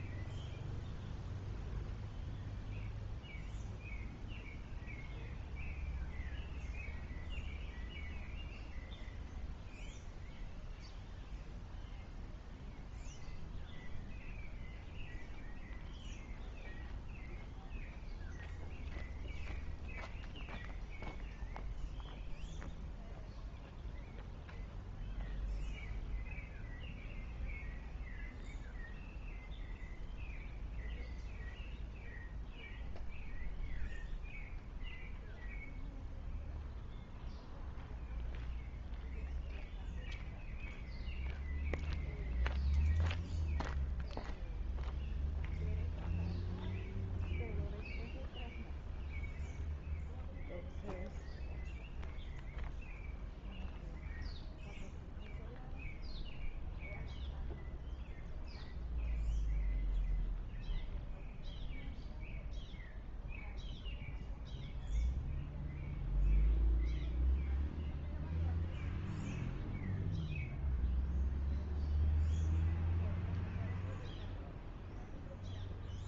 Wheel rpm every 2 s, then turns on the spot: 0, 0, 0, 0, 0, 0, 0, 0, 0, 0, 0, 0, 0, 0, 0, 0, 0, 0, 0, 0, 0, 0, 0, 0, 0, 0, 0, 0, 0, 0, 0, 0, 0, 0, 0, 0, 0, 0.
none